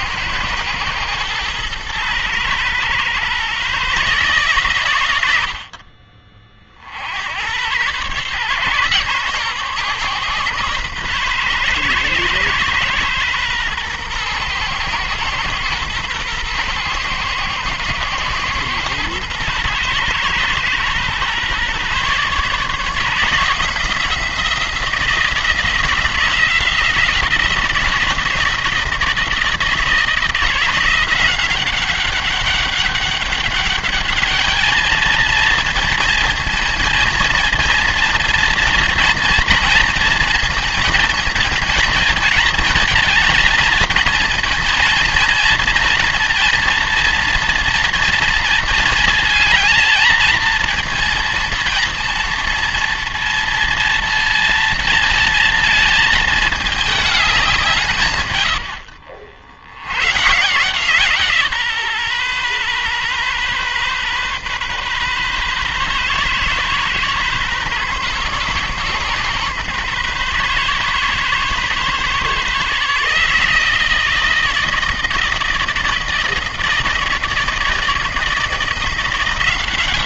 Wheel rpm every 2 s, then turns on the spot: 120, 120, 120, 60, 130, 130, 120, 120, 120, 120, 120, 150, 170, 170, 160, 170, 200, 220, 230, 240, 220, 230, 230, 230, 220, 230, 230, 230, 210, 90, 150, 130, 130, 130, 130, 140, 150, 160, 160, 170.
none